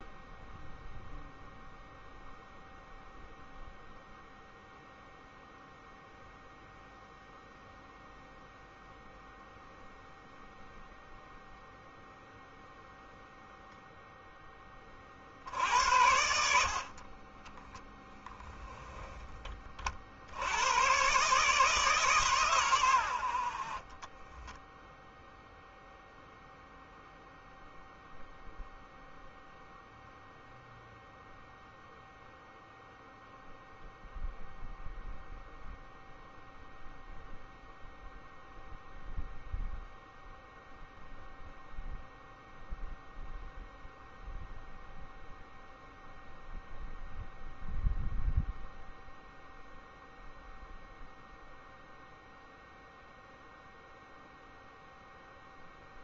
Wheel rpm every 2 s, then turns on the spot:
0, 0, 0, 0, 0, 0, 0, 30, 40, 10, 120, 90, 0, 0, 0, 0, 0, 0, 0, 0, 0, 0, 0, 0, 0, 0, 0, 0.
none